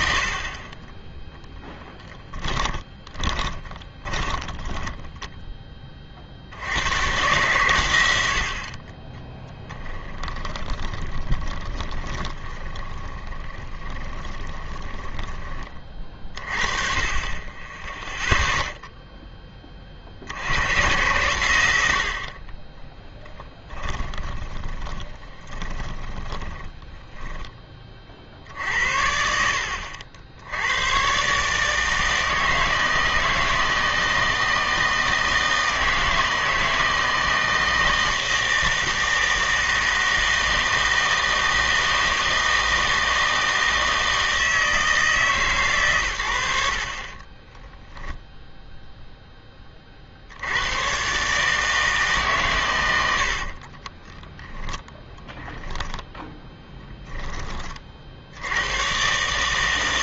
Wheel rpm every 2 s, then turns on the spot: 30, 10, 20, 80, 50, 20, 20, 20, 30, 0, 90, 20, 20, 20, 60, 90, 160, 160, 160, 160, 160, 160, 160, 70, 0, 100, 130, 10, 10, 100.
2-6 10-16 24-28 54-58